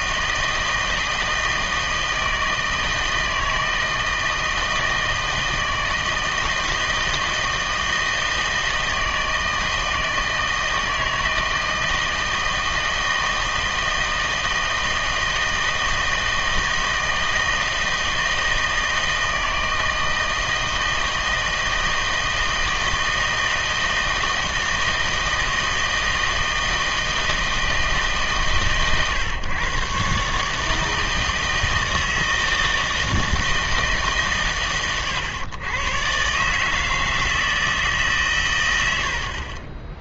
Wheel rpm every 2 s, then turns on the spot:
160, 160, 160, 160, 160, 160, 160, 160, 160, 160, 160, 160, 160, 160, 140, 160, 160, 120, 150, 110.
none